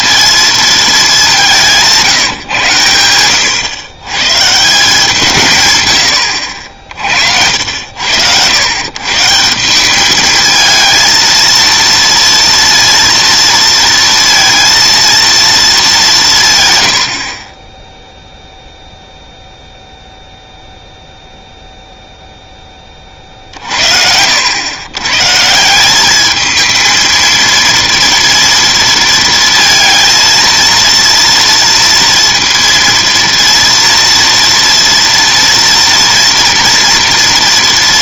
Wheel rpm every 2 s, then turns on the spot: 220, 120, 160, 60, 120, 220, 230, 230, 130, 0, 0, 10, 100, 220, 230, 230, 230, 230, 230.
none